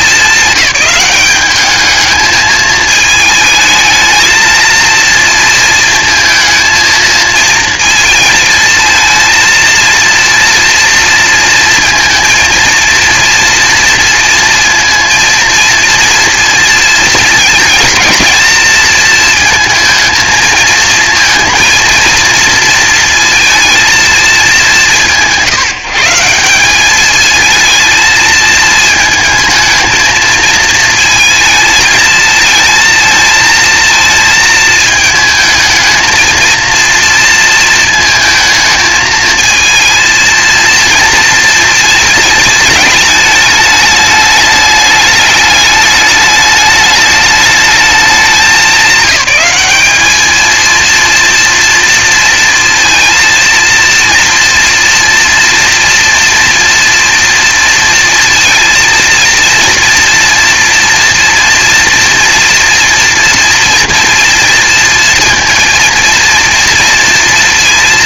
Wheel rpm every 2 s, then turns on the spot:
200, 220, 220, 220, 220, 230, 230, 230, 220, 220, 220, 230, 180, 200, 220, 220, 220, 220, 230, 220, 230, 220, 210, 210, 190, 230, 230, 230, 230, 230, 230, 230, 230, 230.
none